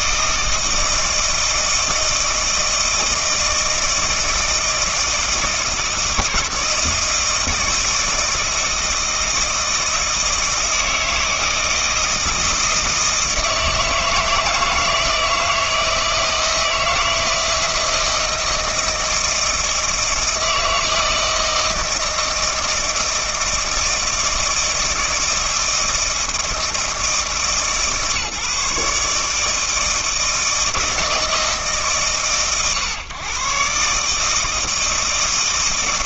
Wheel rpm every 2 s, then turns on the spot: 160, 160, 160, 160, 160, 160, 160, 160, 160, 160, 160, 160, 160, 160, 150, 160, 120, 160.
none